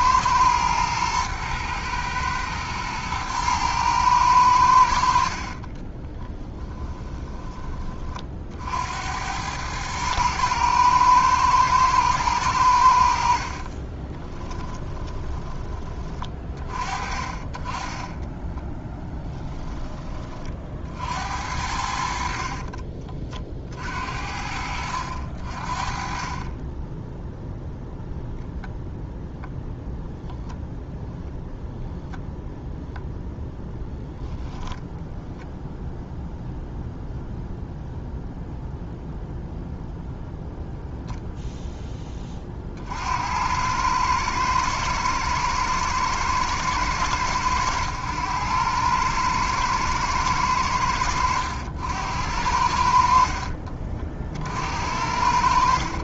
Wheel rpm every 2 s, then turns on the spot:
110, 110, 90, 10, 60, 110, 90, 10, 40, 10, 40, 50, 70, 10, 0, 0, 0, 0, 0, 0, 0, 40, 110, 110, 100, 100, 80, 60.
6-8 14-16 22-24